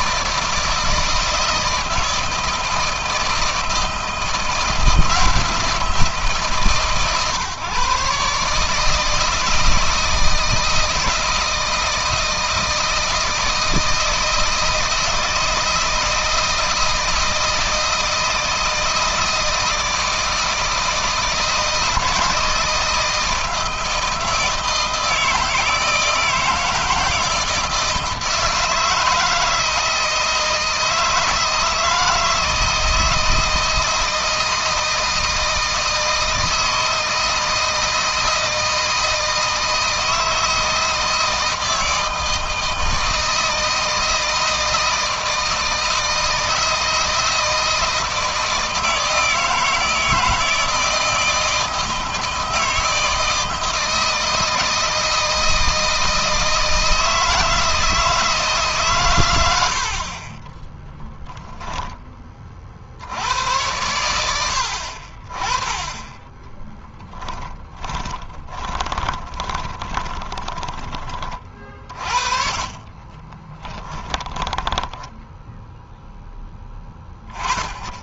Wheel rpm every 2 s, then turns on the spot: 160, 160, 170, 150, 150, 160, 160, 160, 160, 160, 160, 160, 160, 160, 160, 160, 160, 160, 160, 160, 160, 160, 160, 160, 160, 160, 160, 160, 160, 140, 10, 50, 80, 10, 20, 20, 40, 20, 10.
60-62 66-76